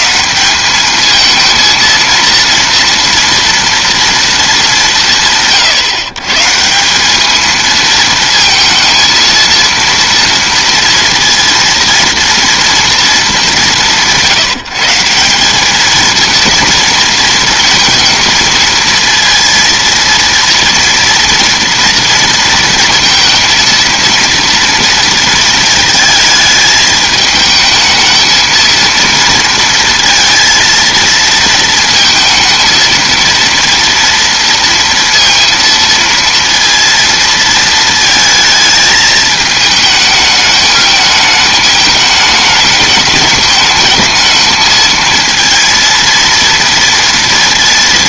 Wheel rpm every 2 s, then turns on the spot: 210, 230, 190, 170, 230, 230, 230, 160, 230, 230, 230, 230, 230, 220, 230, 230, 230, 230, 230, 220, 210, 210, 220, 230.
none